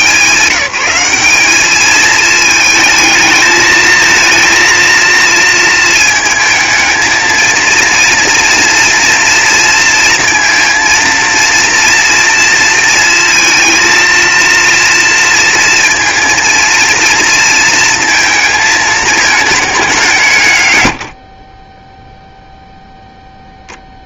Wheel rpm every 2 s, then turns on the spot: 200, 220, 230, 220, 230, 230, 230, 230, 230, 220, 70, 0.
none